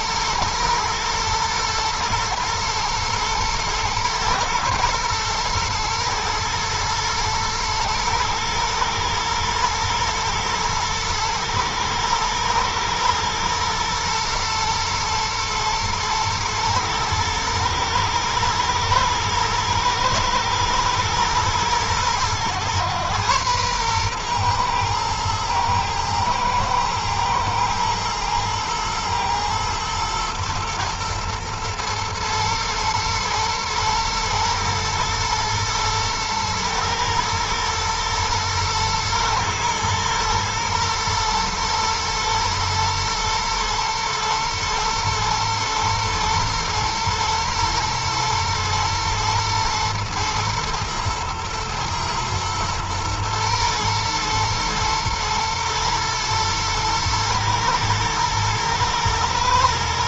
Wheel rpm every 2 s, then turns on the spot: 120, 110, 110, 110, 120, 110, 120, 120, 110, 110, 110, 110, 110, 110, 110, 120, 120, 120, 110, 110, 110, 120, 110, 120, 120, 120, 110, 110, 110, 110.
none